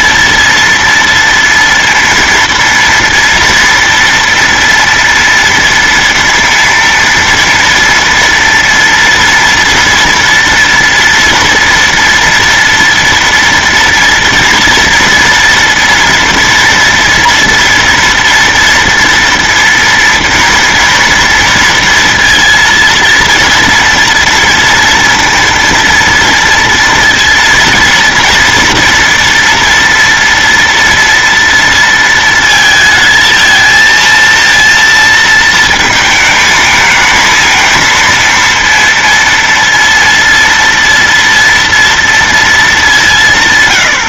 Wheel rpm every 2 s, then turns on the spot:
230, 230, 230, 230, 230, 230, 230, 230, 240, 230, 230, 230, 230, 230, 230, 230, 230, 230, 220, 230, 230, 220.
none